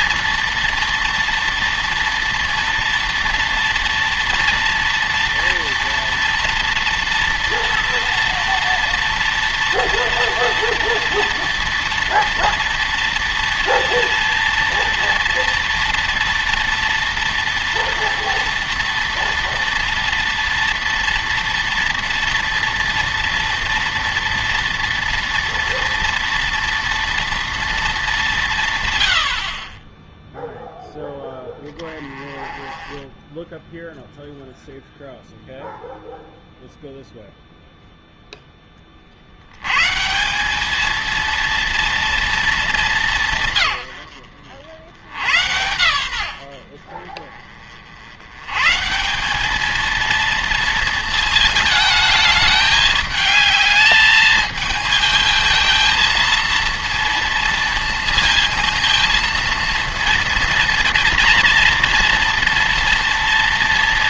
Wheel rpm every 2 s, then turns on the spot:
230, 230, 230, 230, 230, 230, 230, 230, 230, 240, 230, 230, 230, 230, 150, 0, 20, 0, 0, 10, 210, 210, 70, 60, 140, 230, 210, 220, 230, 230, 230, 230.
none